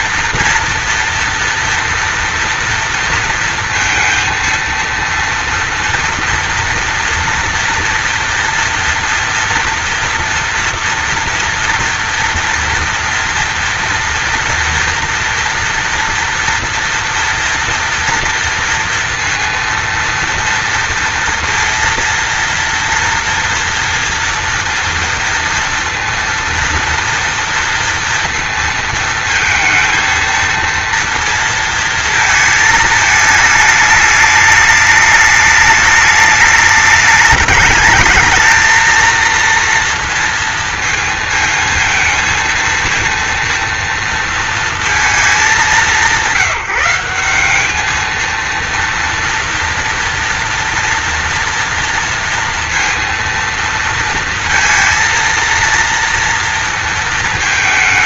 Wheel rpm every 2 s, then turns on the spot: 240, 230, 230, 230, 230, 230, 230, 240, 240, 230, 230, 230, 230, 230, 230, 230, 220, 210, 210, 220, 230, 230, 220, 180, 230, 230, 230, 230, 220.
none